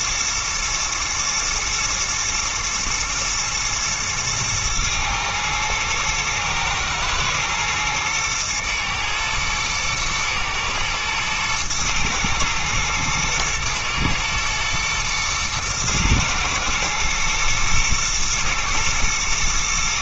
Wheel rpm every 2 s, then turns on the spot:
120, 120, 110, 120, 120, 110, 110, 120, 110, 110.
none